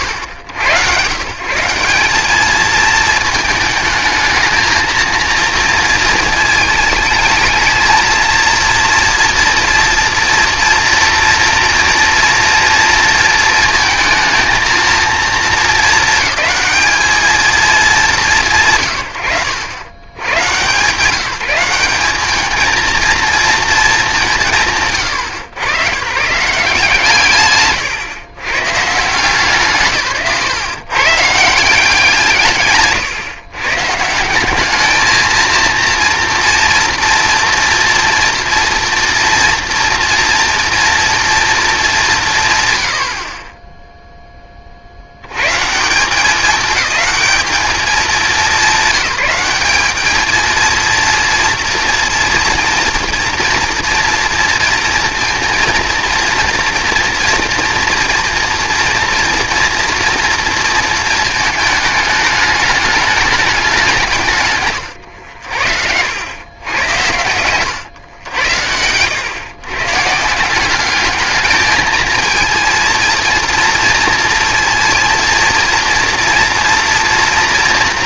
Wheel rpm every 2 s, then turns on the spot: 130, 220, 220, 220, 230, 240, 230, 230, 220, 150, 130, 220, 170, 160, 120, 140, 150, 210, 230, 230, 230, 160, 30, 210, 190, 230, 240, 230, 240, 240, 230, 210, 120, 110, 90, 190, 230, 230, 230.
32-34 64-66 68-70